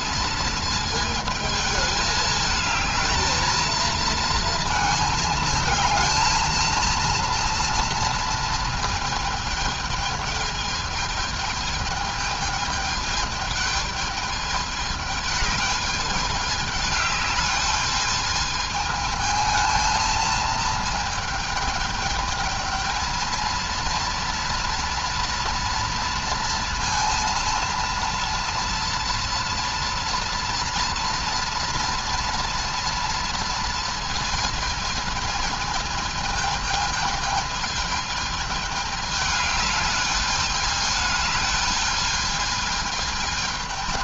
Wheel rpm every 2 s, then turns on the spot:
220, 220, 230, 230, 230, 220, 210, 210, 210, 220, 220, 220, 230, 230, 230, 230, 230, 230, 220, 210, 210, 210.
none